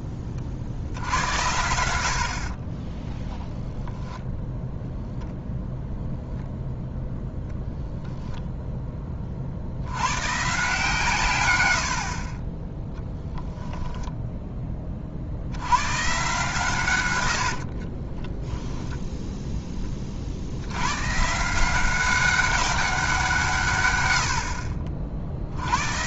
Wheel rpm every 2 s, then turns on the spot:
40, 30, 10, 0, 0, 140, 10, 20, 130, 0, 70, 200, 60.
2-4